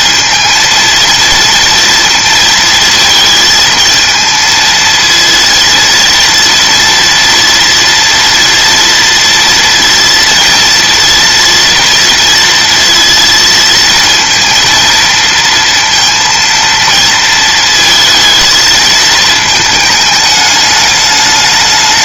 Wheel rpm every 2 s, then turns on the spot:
230, 220, 230, 230, 230, 230, 230, 230, 230, 220, 210.
none